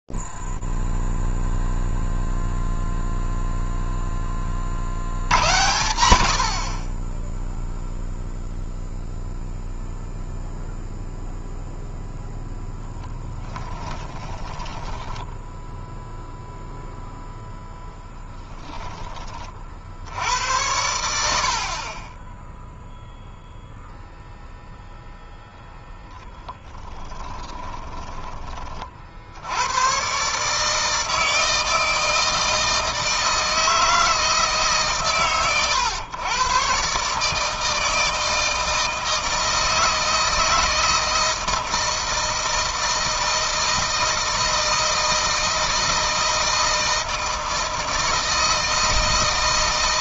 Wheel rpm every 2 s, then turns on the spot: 0, 0, 10, 100, 0, 0, 0, 20, 0, 10, 80, 0, 0, 20, 40, 150, 160, 130, 130, 160, 160, 160, 160, 160, 160.
14-16 26-28